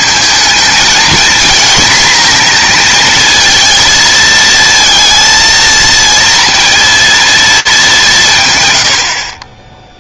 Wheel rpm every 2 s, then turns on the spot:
230, 230, 230, 230, 110.
none